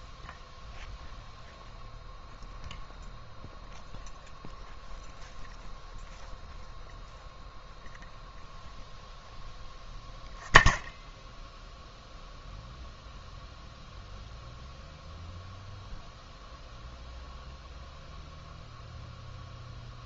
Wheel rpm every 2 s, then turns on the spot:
0, 0, 0, 0, 0, 0, 0, 0, 0, 0.
none